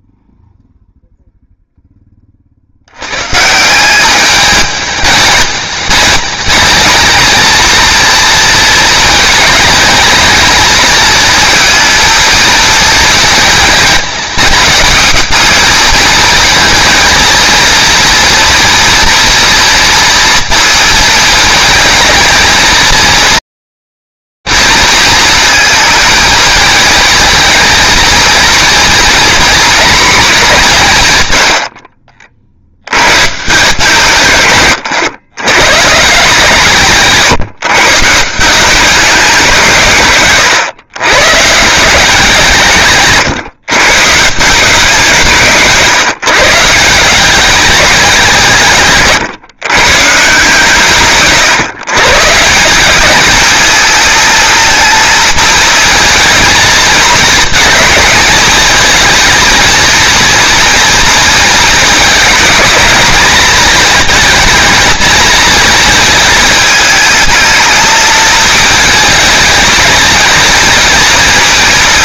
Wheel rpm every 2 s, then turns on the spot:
0, 80, 210, 220, 220, 220, 230, 210, 230, 230, 230, 230, 230, 220, 240, 40, 140, 120, 150, 180, 160, 130, 170, 200, 130, 150, 210, 220, 220, 230, 220, 220, 230, 220, 220, 200.
none